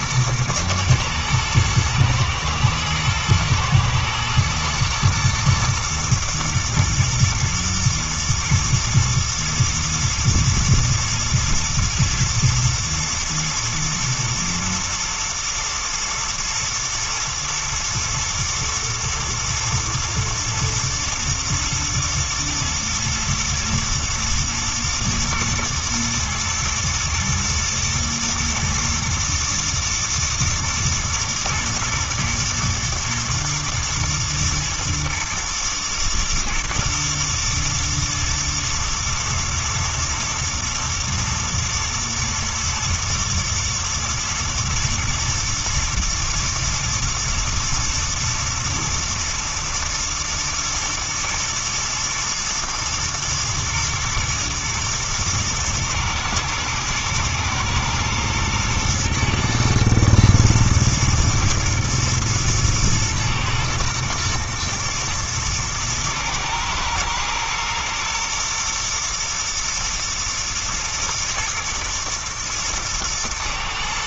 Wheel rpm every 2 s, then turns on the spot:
120, 120, 110, 120, 120, 120, 110, 120, 110, 120, 120, 110, 110, 110, 110, 120, 110, 110, 110, 110, 110, 110, 120, 110, 110, 110, 110, 110, 110, 110, 120, 110, 120, 110, 120, 120, 120.
none